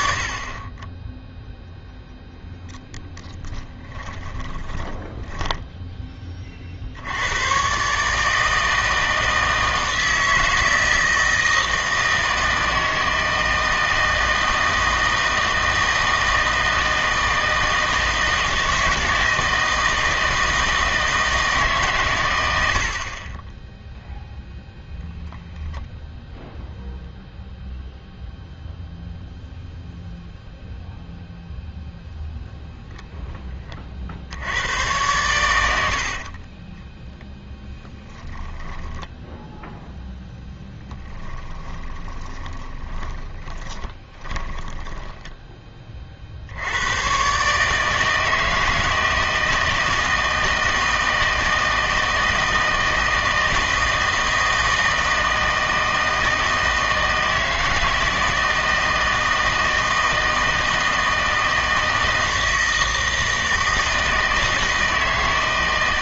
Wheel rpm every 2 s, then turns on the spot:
30, 0, 20, 50, 160, 160, 160, 160, 160, 160, 160, 80, 10, 0, 0, 0, 0, 100, 20, 10, 10, 20, 10, 80, 160, 160, 160, 160, 160, 160, 160, 160, 160.
4-6 38-40 42-46